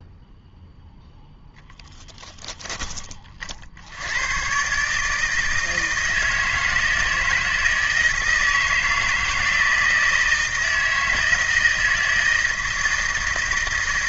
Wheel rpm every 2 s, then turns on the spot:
0, 10, 150, 160, 160, 160, 160.
none